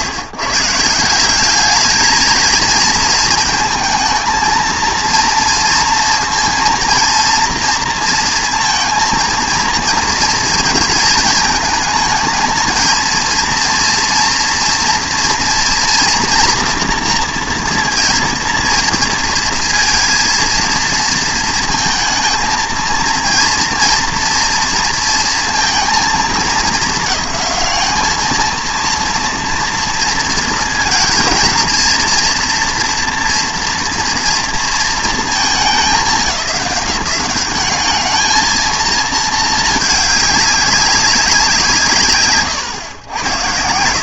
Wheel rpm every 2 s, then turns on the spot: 150, 220, 220, 230, 230, 230, 230, 230, 230, 230, 230, 230, 230, 220, 230, 230, 240, 230, 190, 220, 200, 130.
none